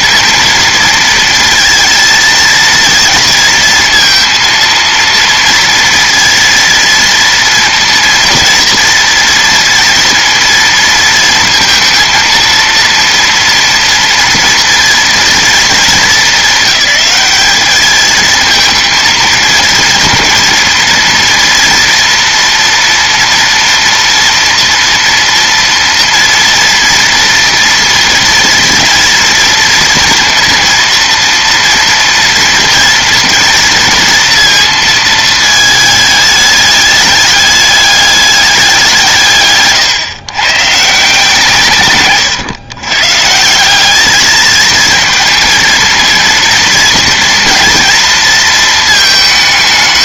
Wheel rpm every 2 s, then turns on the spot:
230, 230, 230, 230, 230, 230, 230, 230, 210, 220, 230, 240, 240, 230, 230, 230, 230, 230, 210, 180, 140, 120, 220, 230, 220.
none